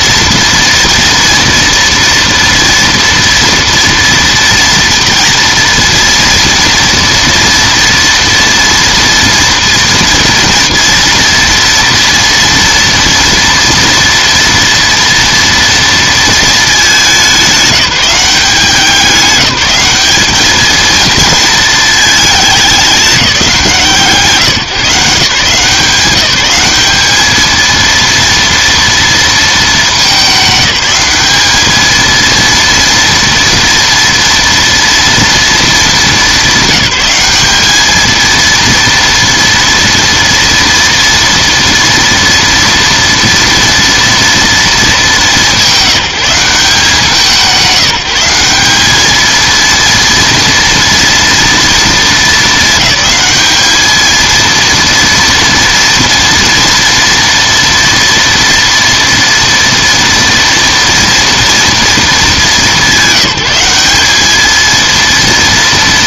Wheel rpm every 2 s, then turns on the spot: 230, 230, 230, 230, 230, 230, 230, 230, 210, 190, 220, 200, 160, 200, 230, 200, 230, 230, 200, 230, 240, 230, 220, 180, 200, 230, 200, 230, 230, 230, 230, 210, 230.
none